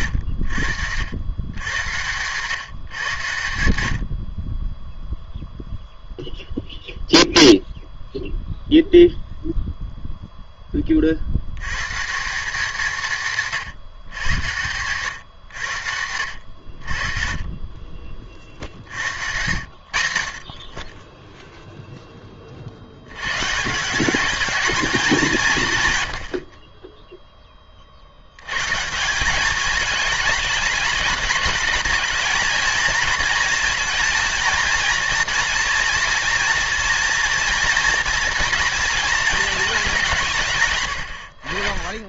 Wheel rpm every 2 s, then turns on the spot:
80, 130, 20, 0, 0, 10, 180, 120, 70, 50, 50, 50, 210, 50, 140, 220, 220, 230, 230, 230, 140.
none